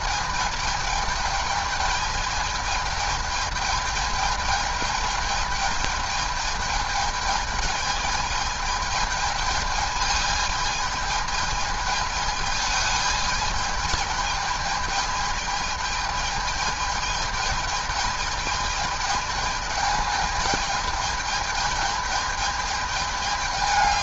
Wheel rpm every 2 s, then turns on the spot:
210, 210, 220, 210, 210, 210, 210, 220, 210, 210, 210, 210.
none